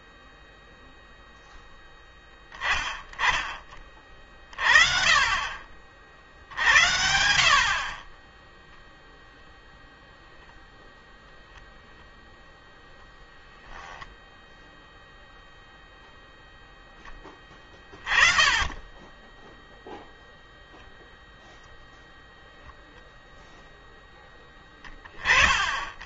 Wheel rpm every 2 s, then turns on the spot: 0, 10, 30, 60, 0, 0, 0, 0, 10, 20, 0, 0, 30.
none